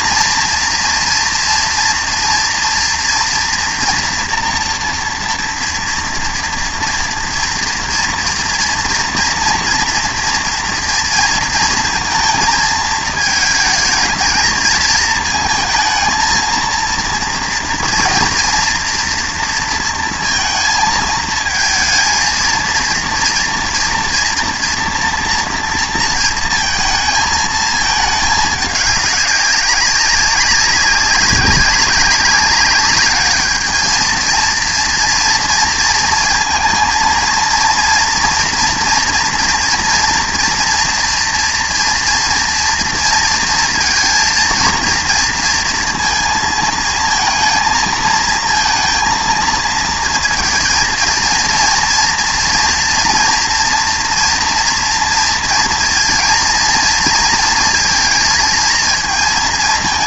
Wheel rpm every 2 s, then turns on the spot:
230, 230, 230, 230, 230, 230, 220, 220, 230, 230, 230, 230, 240, 230, 210, 200, 200, 230, 230, 230, 230, 230, 230, 220, 230, 230, 230, 240, 230, 220.
none